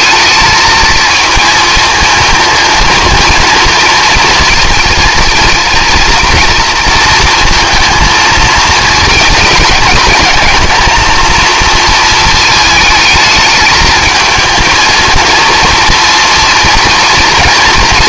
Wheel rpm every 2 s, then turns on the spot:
220, 230, 230, 230, 230, 230, 220, 230, 230.
none